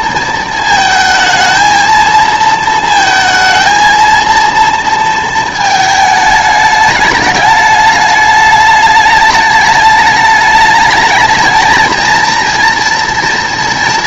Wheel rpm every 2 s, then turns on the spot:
220, 220, 230, 210, 210, 210, 230.
none